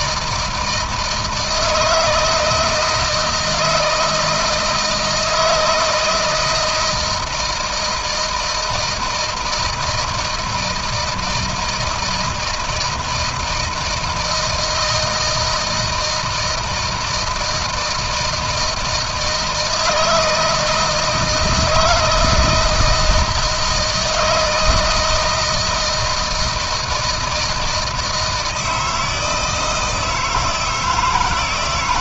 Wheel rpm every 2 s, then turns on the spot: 160, 160, 160, 160, 160, 160, 160, 170, 160, 160, 160, 160, 160, 160, 160, 160.
none